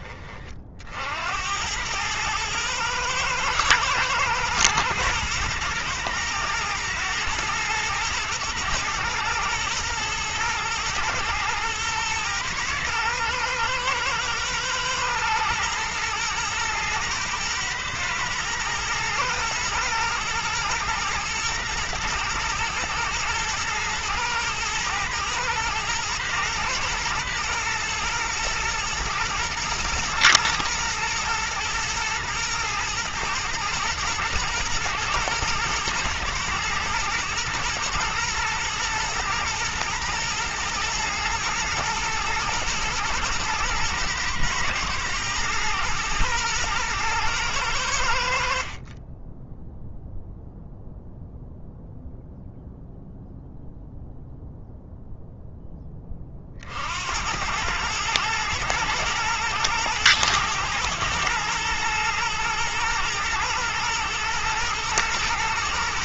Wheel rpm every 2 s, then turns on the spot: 70, 110, 110, 110, 120, 110, 110, 110, 110, 120, 110, 120, 110, 110, 110, 120, 110, 110, 110, 120, 120, 120, 110, 110, 30, 0, 0, 0, 70, 110, 110, 110, 110.
none